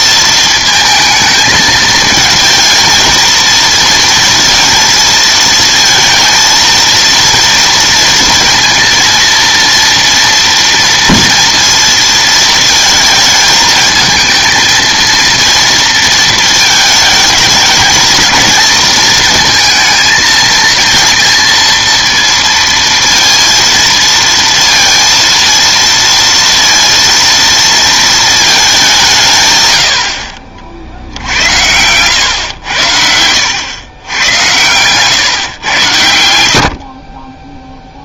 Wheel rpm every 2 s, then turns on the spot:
220, 230, 230, 230, 230, 230, 220, 230, 220, 230, 230, 230, 230, 230, 200, 60, 100, 110, 60.
none